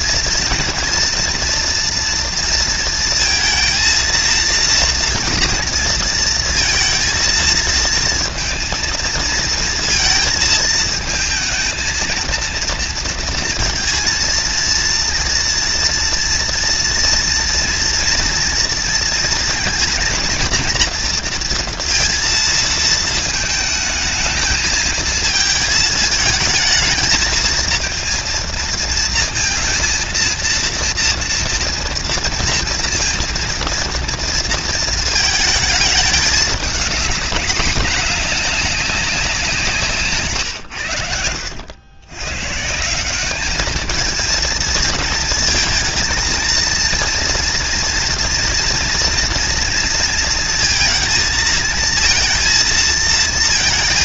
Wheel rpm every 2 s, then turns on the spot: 240, 230, 230, 230, 220, 220, 230, 230, 230, 230, 230, 230, 220, 220, 220, 230, 240, 230, 220, 210, 190, 100, 210, 220, 230, 230, 220.
none